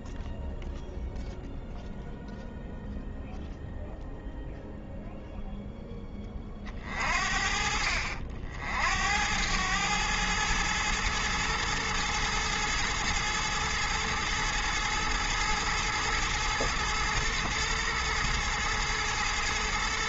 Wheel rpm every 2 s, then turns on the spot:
0, 0, 0, 30, 60, 110, 110, 110, 110, 110.
none